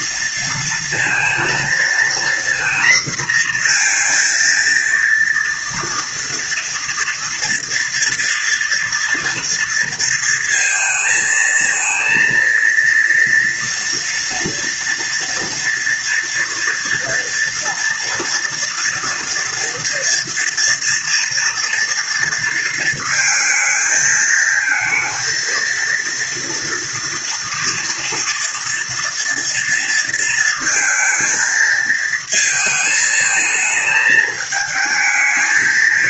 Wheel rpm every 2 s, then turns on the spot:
230, 240, 230, 230, 230, 230, 230, 230, 230, 230, 230, 230, 220, 230, 230, 230, 220, 220.
none